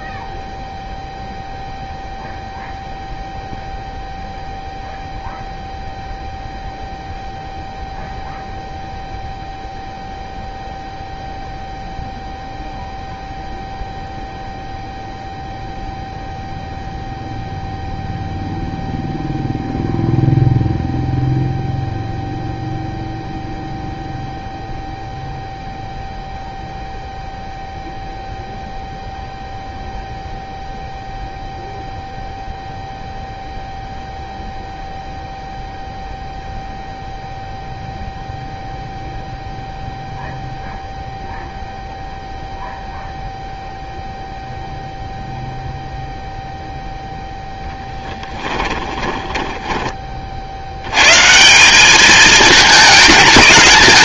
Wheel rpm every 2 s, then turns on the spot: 0, 0, 0, 0, 0, 0, 0, 0, 0, 0, 0, 0, 0, 0, 0, 0, 0, 0, 0, 0, 0, 0, 0, 0, 20, 50, 220.
48-50